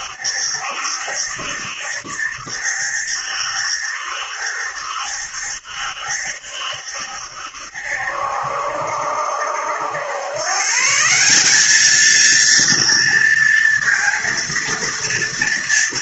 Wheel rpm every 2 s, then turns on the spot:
70, 70, 70, 70, 70, 120, 230, 230.
none